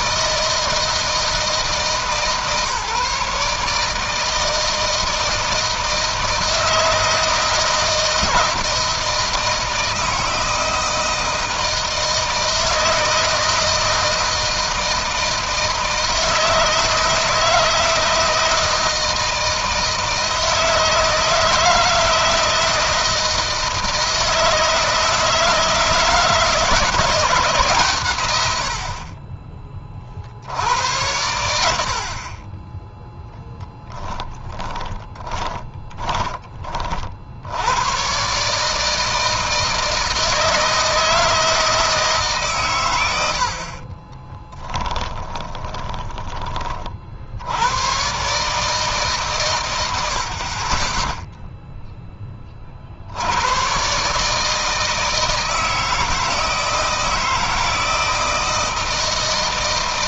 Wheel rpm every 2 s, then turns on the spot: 160, 150, 160, 160, 160, 160, 160, 160, 160, 160, 160, 160, 160, 160, 80, 80, 20, 10, 30, 150, 160, 120, 10, 40, 140, 30, 40, 160, 160, 160.
34-36 44-46